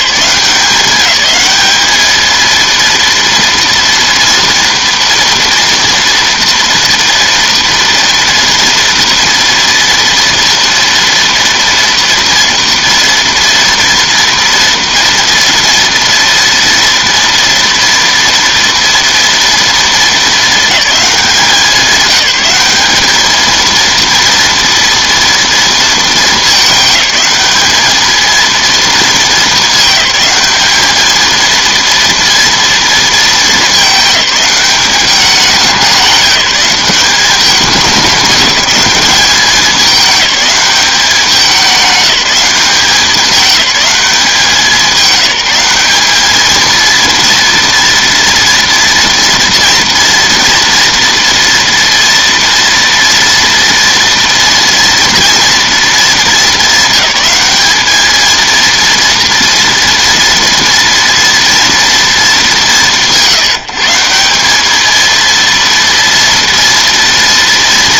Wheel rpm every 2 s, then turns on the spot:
190, 230, 230, 240, 230, 230, 230, 230, 230, 230, 210, 210, 230, 210, 230, 220, 230, 200, 200, 210, 200, 190, 190, 230, 230, 230, 230, 230, 220, 230, 230, 190, 210, 230.
none